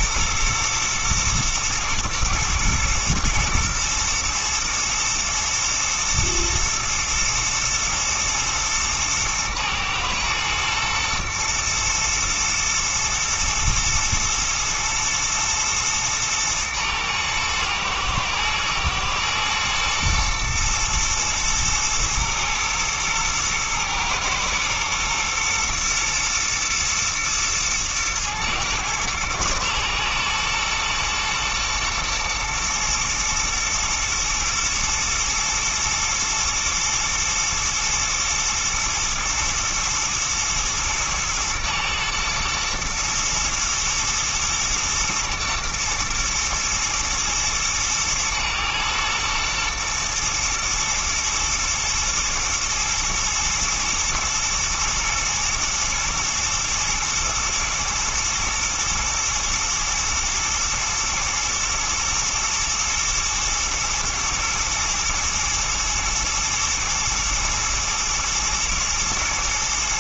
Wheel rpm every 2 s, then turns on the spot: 120, 120, 110, 110, 110, 110, 120, 120, 110, 110, 110, 120, 120, 110, 110, 120, 120, 110, 120, 110, 110, 120, 120, 120, 110, 110, 120, 110, 120, 110, 120, 120, 120, 120, 120.
none